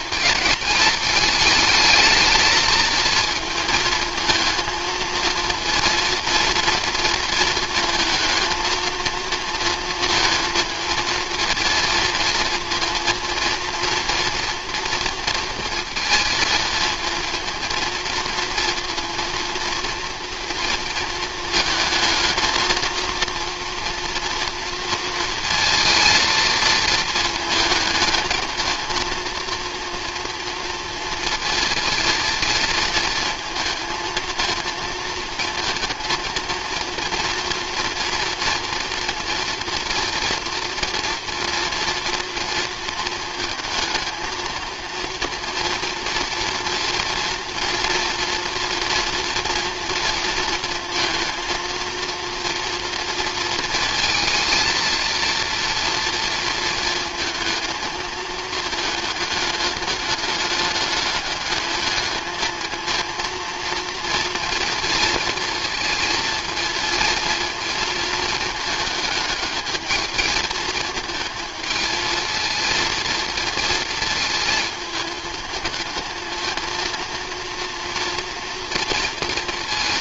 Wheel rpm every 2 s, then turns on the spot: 210, 220, 230, 230, 220, 230, 230, 230, 230, 230, 230, 220, 230, 230, 230, 230, 220, 230, 230, 230, 230, 230, 230, 230, 240, 230, 230, 230, 230, 220, 210, 220, 230, 230, 220, 220, 230, 220, 220, 230.
none